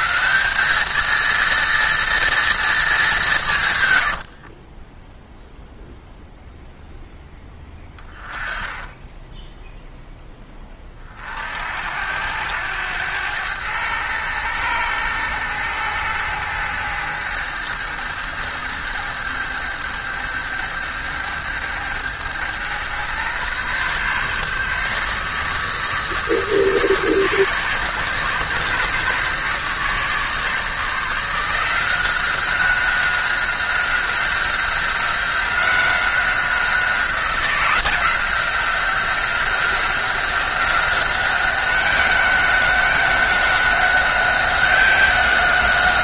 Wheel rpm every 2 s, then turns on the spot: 200, 220, 40, 0, 10, 20, 90, 110, 110, 110, 110, 120, 140, 150, 140, 150, 190, 180, 180, 180, 190, 190, 190.
4-6